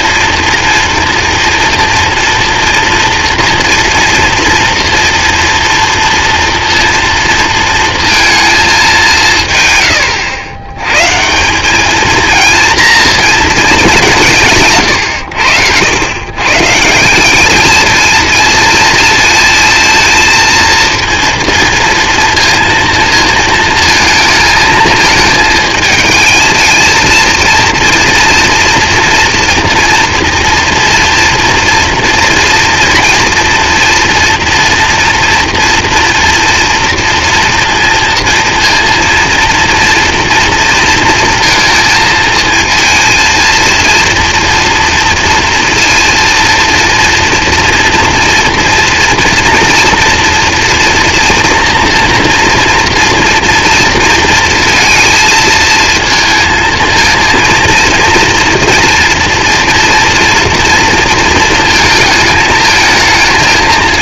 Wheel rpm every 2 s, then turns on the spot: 230, 240, 230, 230, 220, 100, 230, 150, 150, 230, 230, 230, 220, 220, 230, 240, 230, 230, 230, 230, 230, 230, 230, 230, 230, 230, 230, 230, 230, 230, 230, 220.
none